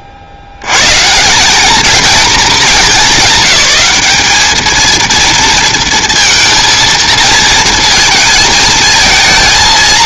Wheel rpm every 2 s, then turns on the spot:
90, 200, 220, 230, 220.
none